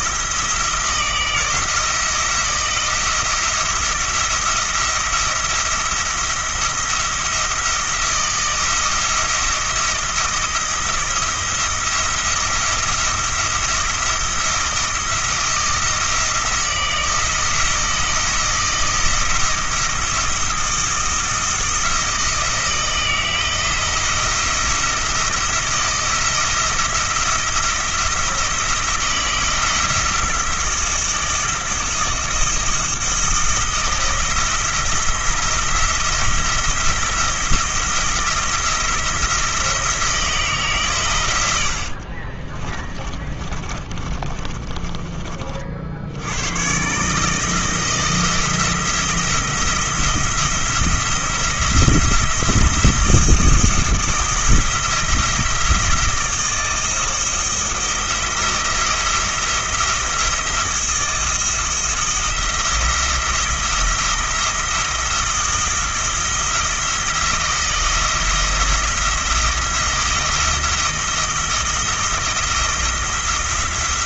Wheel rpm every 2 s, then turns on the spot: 170, 170, 170, 170, 170, 170, 170, 170, 160, 160, 170, 170, 160, 170, 170, 170, 170, 170, 170, 160, 130, 20, 20, 130, 170, 170, 170, 170, 160, 170, 170, 170, 170, 170, 170, 170, 170.
42-46